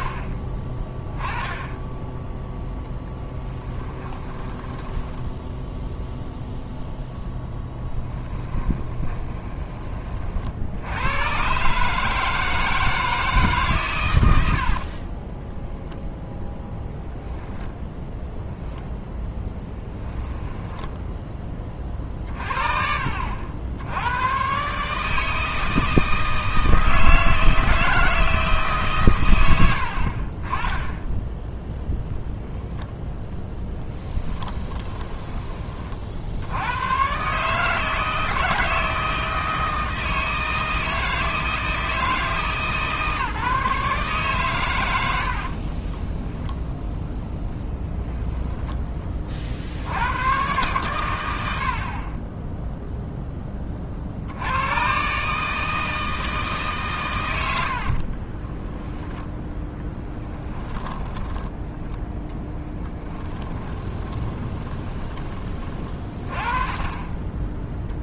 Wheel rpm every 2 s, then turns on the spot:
10, 10, 10, 0, 20, 90, 160, 40, 0, 0, 10, 50, 150, 160, 130, 10, 0, 10, 100, 160, 160, 150, 80, 0, 20, 120, 0, 120, 140, 10, 10, 10, 30, 20.
4-6 8-10 14-16 34-36 58-66